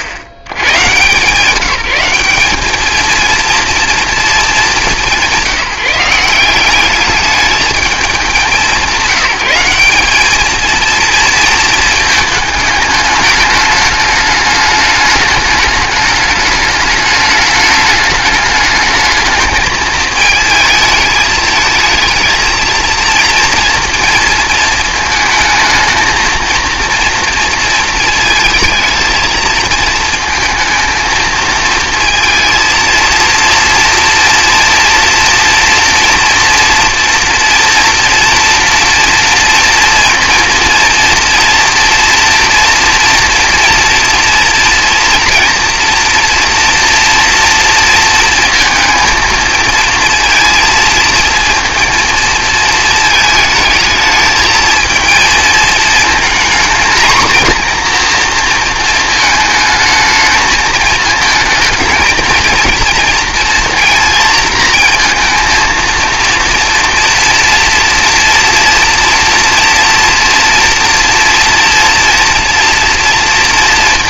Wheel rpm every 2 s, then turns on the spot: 70, 210, 190, 200, 190, 230, 210, 210, 210, 210, 220, 230, 220, 230, 220, 220, 230, 230, 230, 230, 230, 240, 230, 230, 230, 230, 220, 220, 230, 220, 220, 230, 230, 230, 230, 230, 230.
none